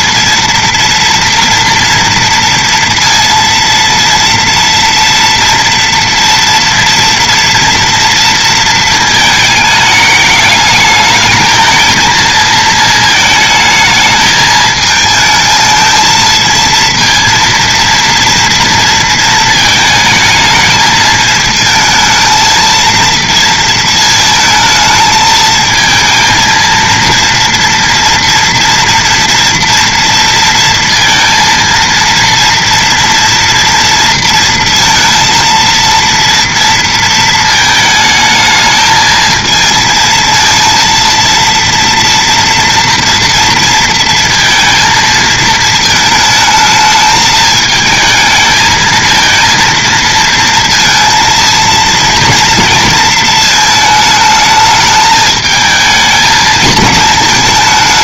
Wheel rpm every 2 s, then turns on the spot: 230, 230, 230, 230, 230, 210, 220, 220, 230, 230, 220, 230, 220, 230, 230, 230, 230, 230, 230, 220, 230, 230, 230, 220, 220, 230, 230, 220, 220.
none